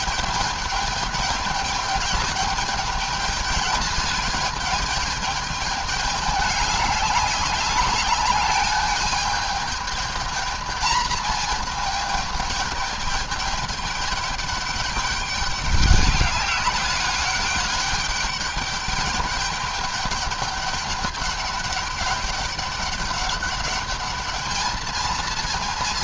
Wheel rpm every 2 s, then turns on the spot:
210, 220, 210, 200, 210, 220, 210, 200, 200, 210, 210, 200, 220.
none